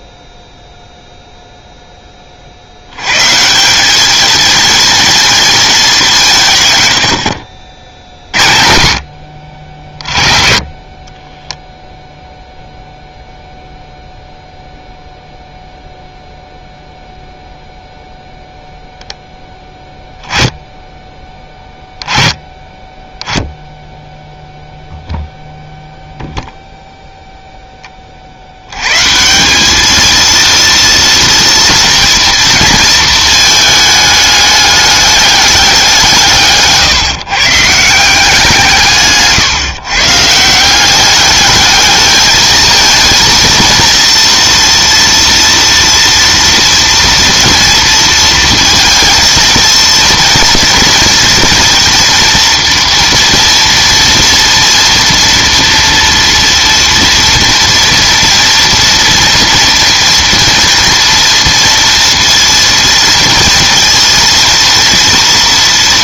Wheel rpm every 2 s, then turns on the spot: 0, 60, 230, 150, 50, 40, 0, 0, 0, 0, 10, 20, 0, 0, 90, 230, 230, 210, 150, 170, 170, 220, 230, 230, 230, 230, 230, 230, 230, 230, 230, 230, 230.
none